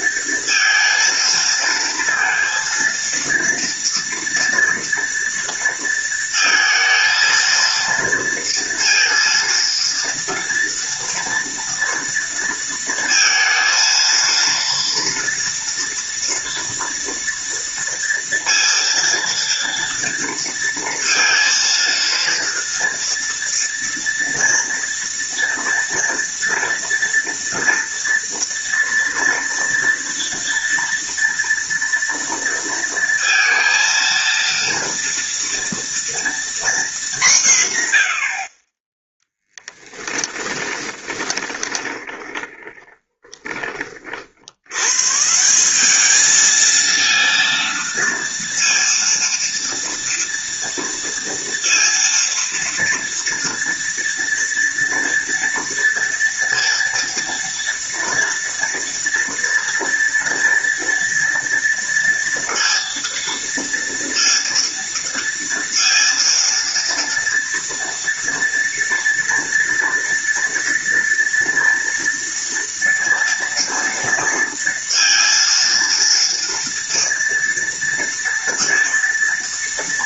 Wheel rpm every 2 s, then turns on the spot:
230, 230, 230, 230, 230, 230, 230, 230, 230, 230, 230, 230, 230, 230, 230, 230, 230, 230, 210, 10, 20, 20, 140, 230, 230, 230, 230, 230, 230, 230, 230, 230, 230, 230, 230, 230, 230, 230, 230, 240.
40-44